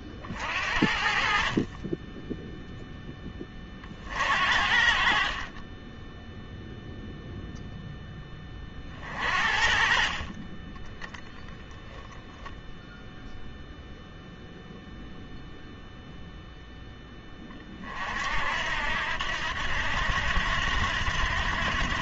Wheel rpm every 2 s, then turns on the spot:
50, 0, 60, 0, 40, 20, 0, 0, 10, 70, 80.
none